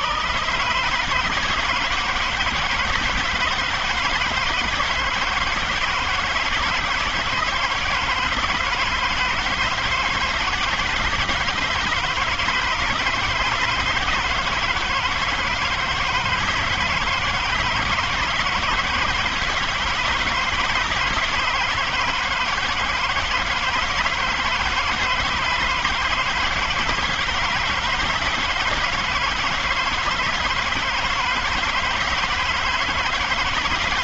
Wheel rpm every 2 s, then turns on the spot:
130, 160, 150, 160, 160, 150, 160, 160, 160, 160, 160, 160, 160, 160, 170, 160, 160.
none